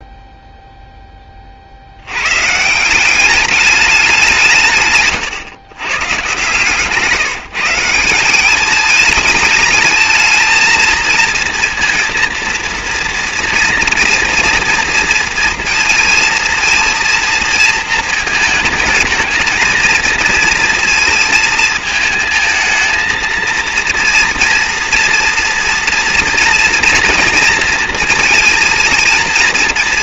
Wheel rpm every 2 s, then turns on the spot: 0, 150, 170, 140, 200, 220, 230, 230, 230, 220, 230, 220, 230, 230, 230.
6-8